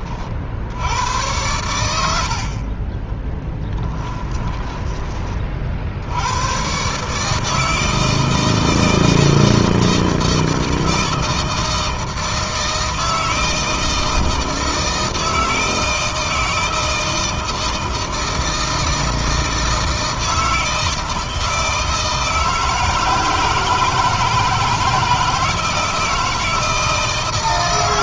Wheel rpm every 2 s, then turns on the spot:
70, 20, 20, 120, 160, 160, 160, 160, 160, 160, 160, 160, 160, 160.
2-4